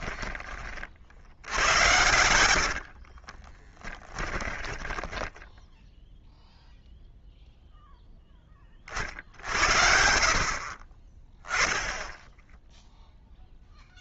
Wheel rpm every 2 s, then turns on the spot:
30, 70, 20, 0, 30, 40, 0.
2-6